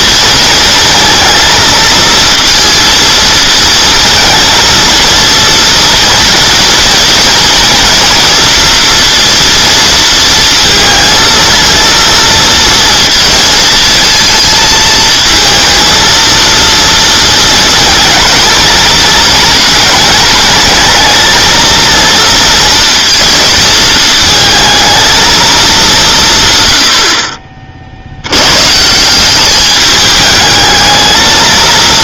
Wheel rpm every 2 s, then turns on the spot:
230, 230, 230, 230, 230, 230, 230, 230, 230, 220, 210, 230, 230, 90, 150, 220.
none